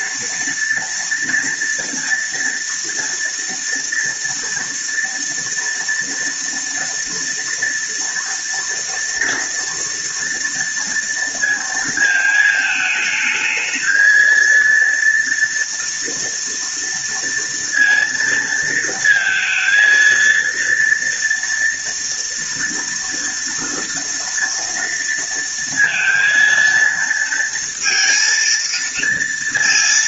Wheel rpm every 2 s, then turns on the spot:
230, 230, 230, 230, 230, 230, 220, 230, 230, 230, 230, 230, 230, 230, 230.
none